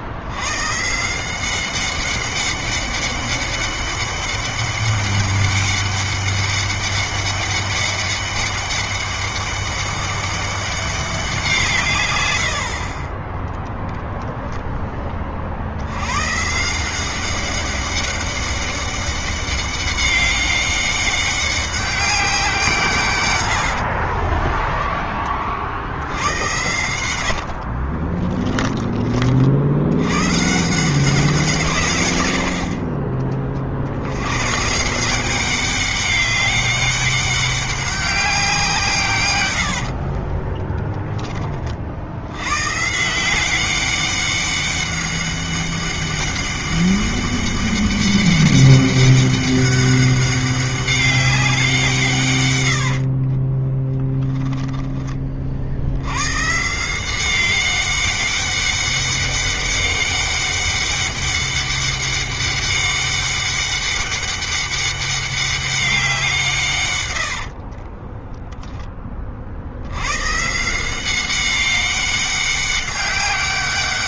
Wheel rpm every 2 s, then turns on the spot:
140, 200, 200, 200, 200, 190, 60, 20, 170, 200, 200, 160, 20, 90, 30, 170, 50, 160, 200, 150, 10, 140, 200, 200, 200, 200, 100, 10, 160, 200, 200, 200, 200, 130, 20, 170, 190.
26-28 52-54 66-68